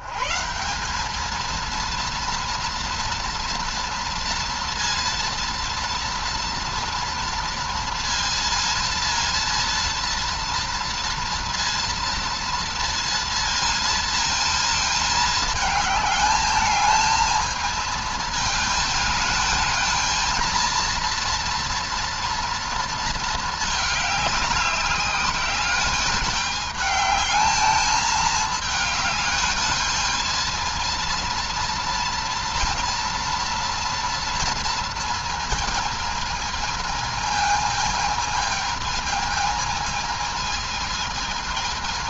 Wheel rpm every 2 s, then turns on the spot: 190, 230, 230, 230, 230, 240, 230, 220, 220, 220, 230, 230, 200, 210, 210, 230, 230, 230, 220, 220, 220.
none